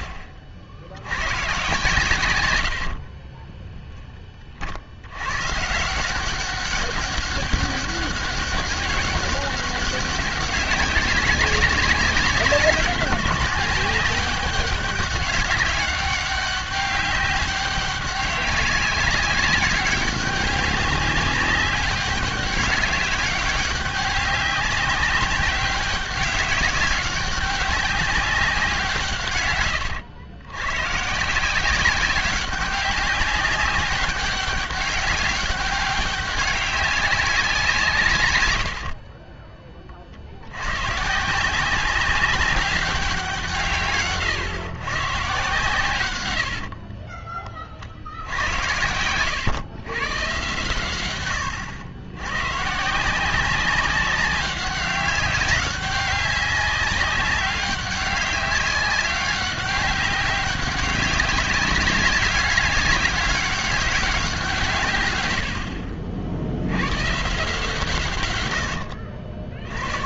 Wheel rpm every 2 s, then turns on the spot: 90, 60, 80, 200, 200, 190, 190, 200, 190, 200, 200, 200, 200, 190, 150, 140, 200, 200, 190, 50, 130, 190, 120, 40, 100, 110, 150, 200, 200, 200, 190, 200, 130, 110, 80.
2-4 38-40 46-50 68-70